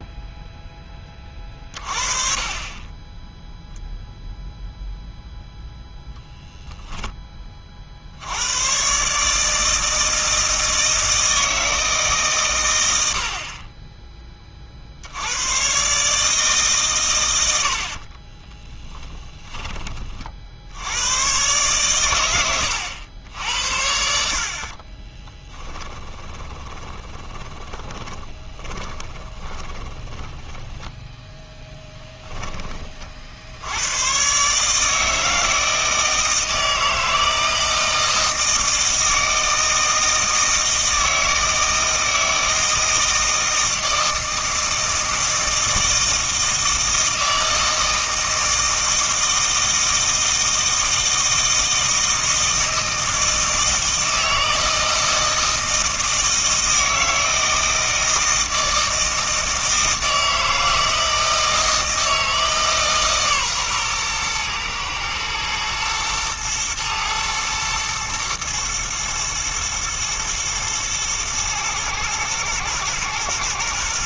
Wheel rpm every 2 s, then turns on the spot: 10, 10, 0, 0, 120, 160, 100, 50, 130, 20, 80, 100, 30, 10, 20, 20, 30, 150, 160, 160, 160, 160, 160, 160, 160, 160, 160, 160, 160, 160, 160, 150, 120, 120, 120, 110, 110.
18-20 24-32